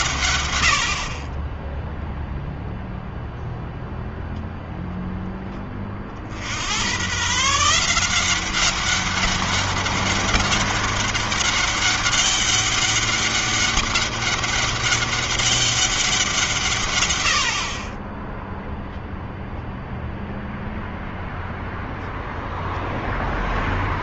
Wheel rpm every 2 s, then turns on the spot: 40, 0, 0, 120, 200, 200, 200, 200, 120, 0, 0, 0.
none